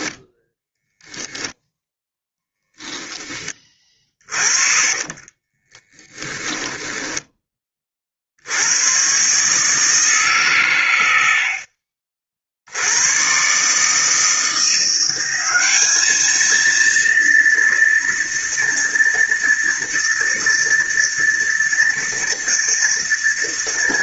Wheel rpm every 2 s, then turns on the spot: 0, 10, 30, 10, 90, 120, 80, 170, 230, 230, 230, 230.
4-8